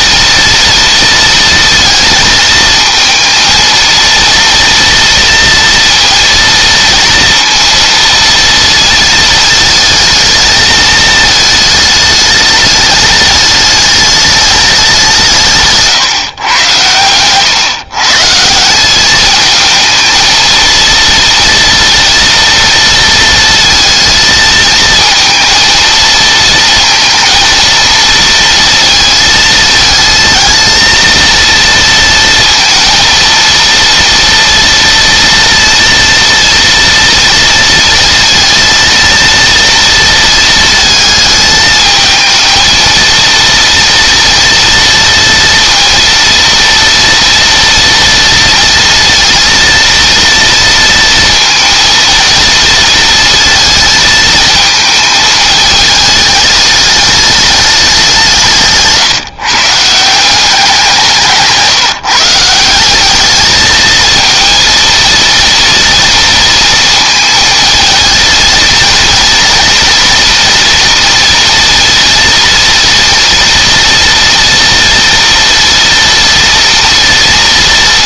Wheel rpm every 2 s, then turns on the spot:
230, 230, 230, 230, 220, 220, 210, 190, 120, 190, 230, 230, 220, 230, 230, 230, 230, 230, 230, 230, 220, 230, 230, 230, 230, 230, 230, 220, 210, 150, 180, 190, 230, 220, 230, 230, 230, 230, 230.
none